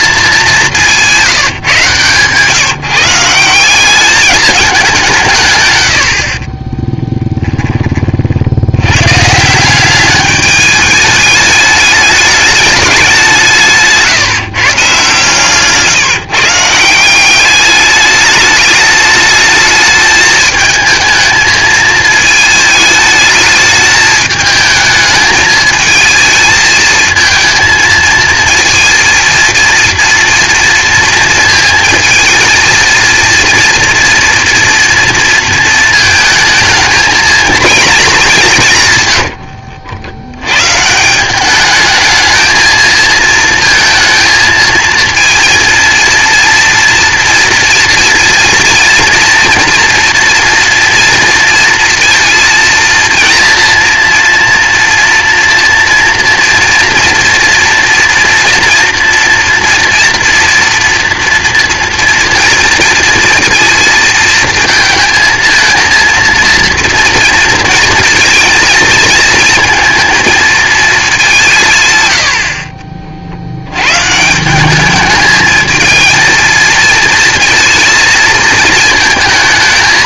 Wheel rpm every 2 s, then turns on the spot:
180, 160, 190, 20, 100, 210, 200, 140, 160, 210, 220, 220, 220, 220, 230, 230, 230, 240, 220, 140, 140, 220, 230, 230, 240, 240, 230, 240, 240, 240, 230, 230, 230, 230, 230, 220, 40, 190, 230, 220.
6-8